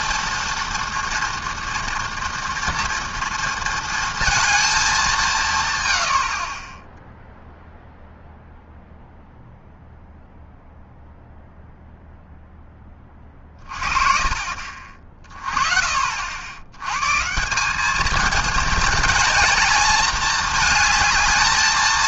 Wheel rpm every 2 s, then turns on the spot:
230, 240, 220, 40, 0, 0, 10, 40, 90, 230, 220.
none